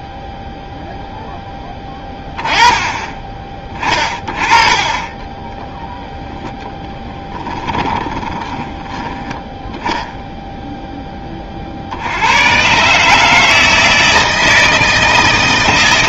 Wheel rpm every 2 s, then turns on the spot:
0, 20, 30, 10, 10, 10, 140, 160.
4-8